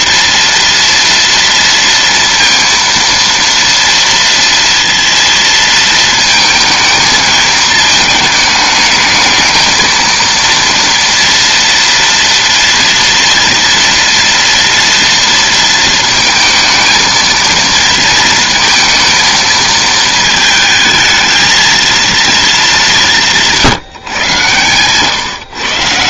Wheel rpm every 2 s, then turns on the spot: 230, 230, 230, 220, 220, 230, 230, 230, 220, 230, 220, 220, 130.
none